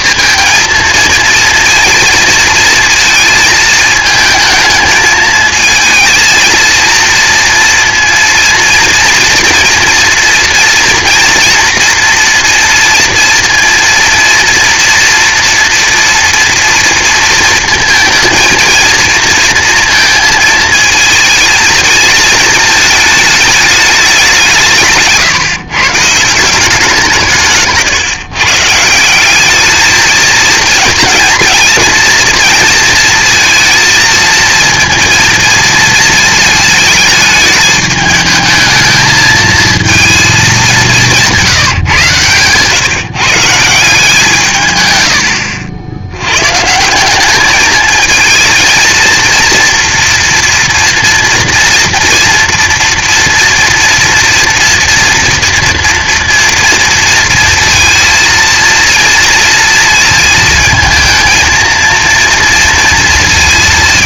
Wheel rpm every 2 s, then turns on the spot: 230, 230, 220, 230, 230, 230, 230, 230, 230, 230, 220, 210, 150, 170, 160, 230, 230, 230, 220, 220, 200, 140, 110, 180, 230, 230, 230, 230, 230, 230, 220, 230.
none